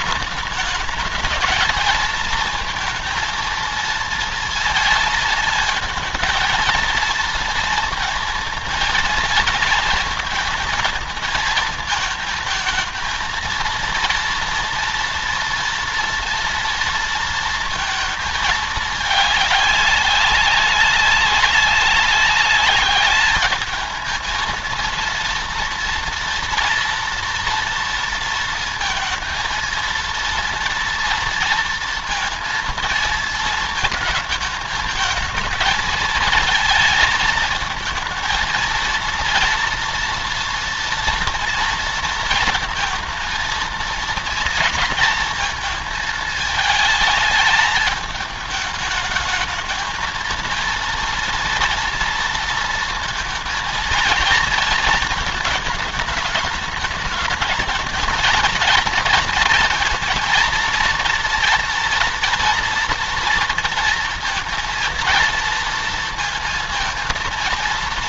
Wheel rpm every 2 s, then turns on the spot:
210, 220, 230, 230, 230, 230, 220, 230, 230, 220, 200, 200, 230, 230, 230, 230, 230, 220, 220, 230, 230, 230, 230, 220, 210, 220, 230, 230, 210, 230, 240, 230, 230, 230.
none